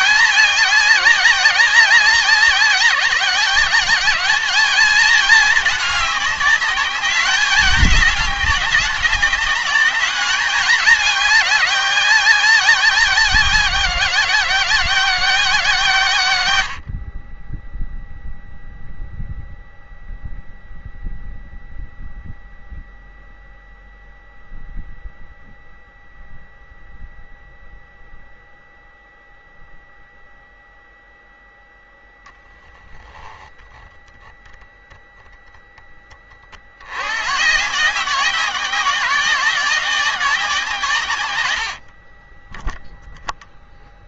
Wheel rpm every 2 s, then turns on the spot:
210, 190, 210, 200, 200, 210, 190, 180, 100, 0, 0, 0, 0, 0, 0, 0, 0, 0, 40, 180, 170, 30.
42-44